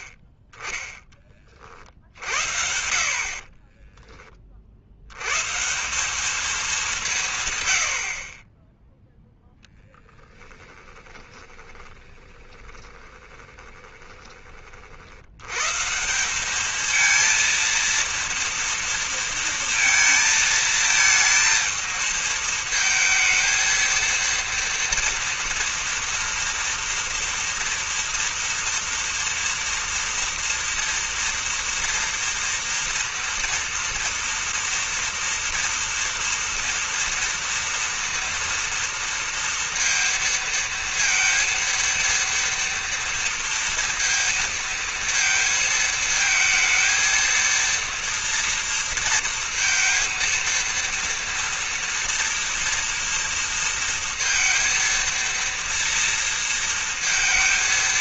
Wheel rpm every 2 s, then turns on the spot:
20, 60, 30, 200, 40, 10, 20, 30, 190, 230, 220, 220, 230, 230, 240, 240, 230, 230, 230, 230, 230, 230, 230, 220, 230, 230, 230, 230, 230.
8-14